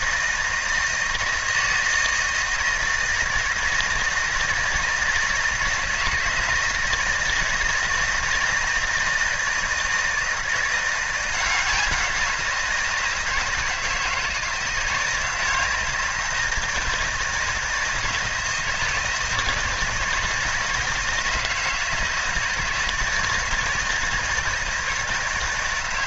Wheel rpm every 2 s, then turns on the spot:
160, 160, 160, 160, 160, 170, 170, 160, 160, 160, 160, 160, 160.
none